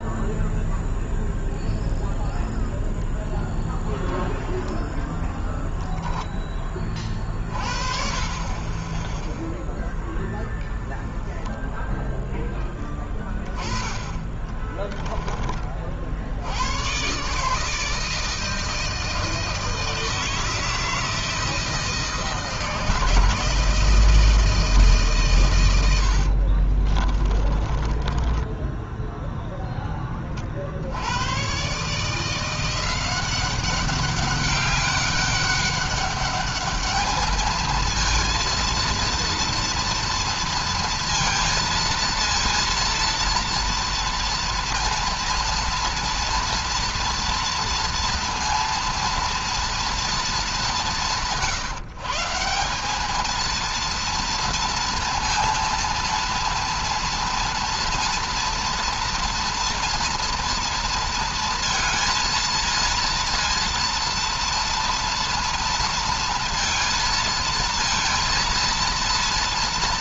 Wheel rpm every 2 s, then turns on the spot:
0, 0, 10, 30, 10, 10, 10, 10, 110, 160, 160, 160, 150, 40, 0, 70, 180, 200, 210, 230, 230, 230, 230, 240, 230, 180, 190, 230, 230, 240, 230, 230, 230, 230, 230.
14-16 26-28